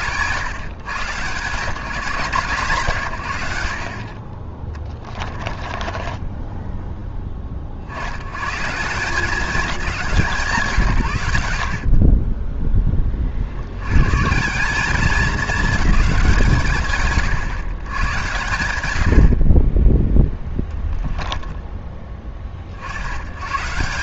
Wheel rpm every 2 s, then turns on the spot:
120, 110, 30, 20, 190, 160, 30, 200, 130, 90, 10, 70.
4-6